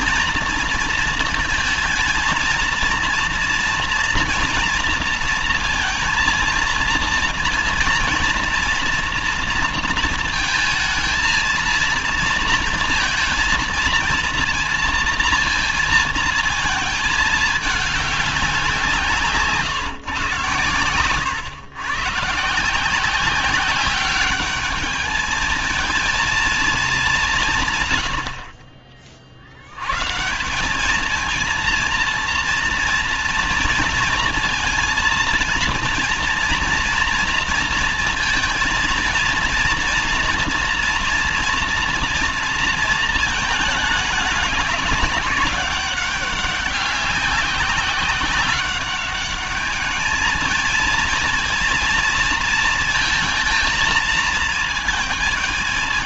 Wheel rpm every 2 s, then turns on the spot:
230, 230, 230, 230, 230, 220, 230, 230, 220, 180, 120, 160, 210, 210, 40, 190, 230, 230, 230, 230, 240, 230, 210, 200, 190, 230, 230, 220.
none